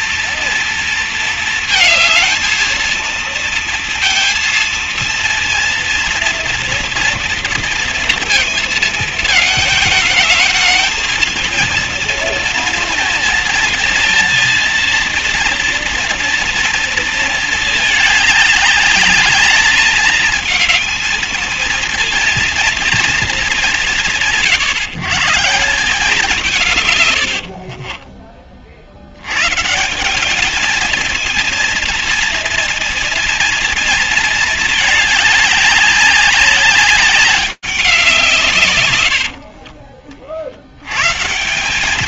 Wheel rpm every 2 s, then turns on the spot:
230, 220, 230, 230, 230, 220, 230, 230, 230, 210, 210, 230, 150, 180, 50, 200, 230, 220, 200, 150, 70.
28-30